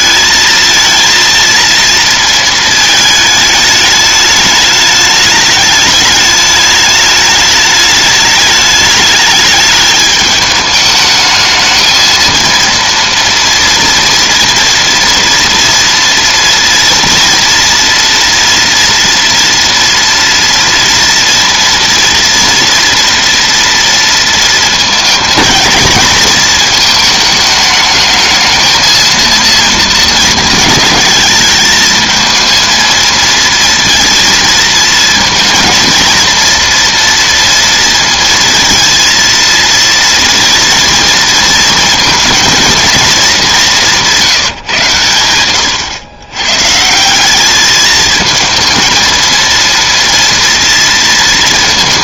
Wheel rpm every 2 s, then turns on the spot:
220, 230, 210, 210, 210, 210, 230, 240, 230, 230, 230, 230, 230, 220, 220, 220, 220, 230, 230, 230, 230, 230, 150, 140, 230, 230.
none